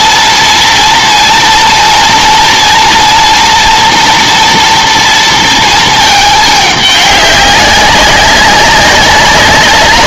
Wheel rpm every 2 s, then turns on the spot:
230, 230, 230, 210, 190.
none